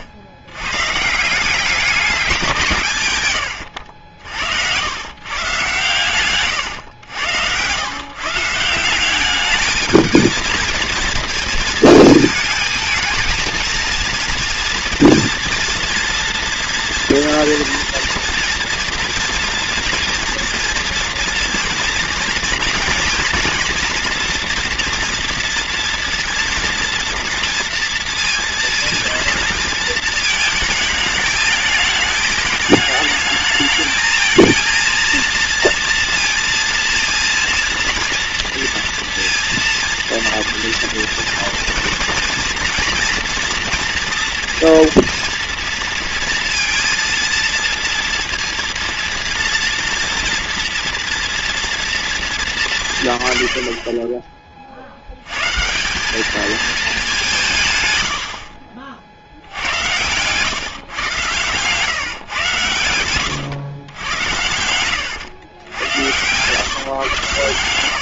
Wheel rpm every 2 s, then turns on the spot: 110, 180, 80, 120, 170, 230, 220, 230, 240, 240, 240, 230, 240, 230, 230, 220, 210, 230, 230, 230, 230, 240, 230, 230, 230, 230, 160, 50, 220, 50, 130, 110, 100, 130.
6-8 64-66